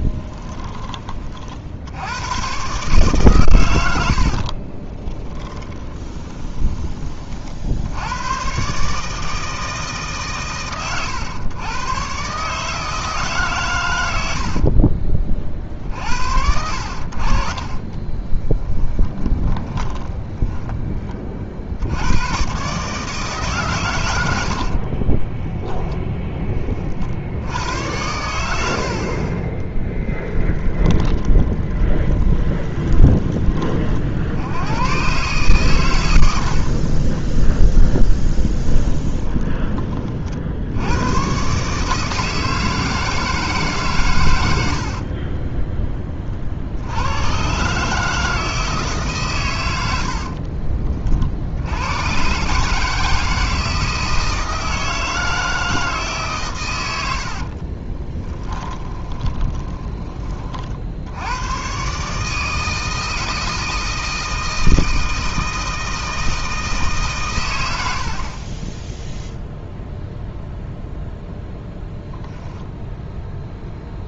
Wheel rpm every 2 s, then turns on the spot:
20, 140, 30, 20, 140, 120, 150, 50, 70, 20, 20, 140, 50, 30, 70, 20, 10, 100, 50, 10, 80, 160, 60, 60, 150, 30, 150, 160, 110, 20, 50, 160, 160, 150, 10, 0, 0.
4-6 14-16 18-22 24-26 30-34 36-40 44-46 50-52 56-60